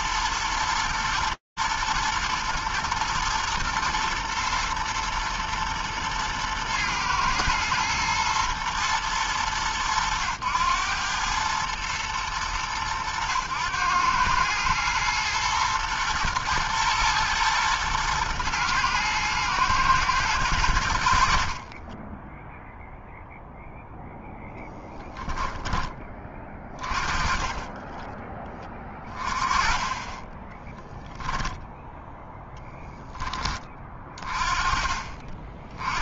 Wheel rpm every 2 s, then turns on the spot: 110, 120, 110, 120, 120, 100, 110, 110, 110, 120, 110, 10, 0, 30, 20, 20, 0, 30.
22-24 30-32